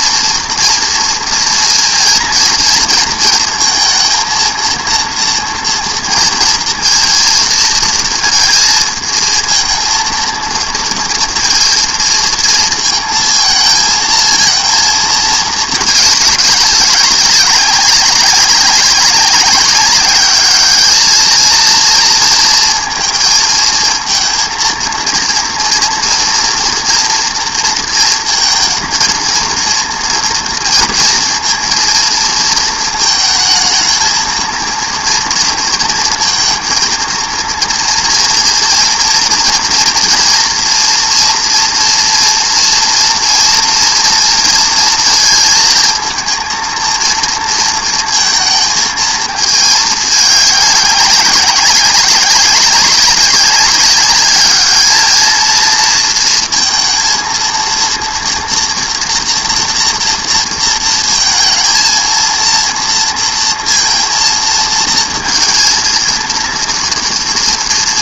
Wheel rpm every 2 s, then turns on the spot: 230, 230, 230, 230, 220, 230, 230, 230, 200, 190, 210, 230, 230, 230, 230, 240, 230, 230, 230, 230, 230, 230, 230, 220, 220, 200, 190, 210, 230, 230, 230, 230, 230, 230.
none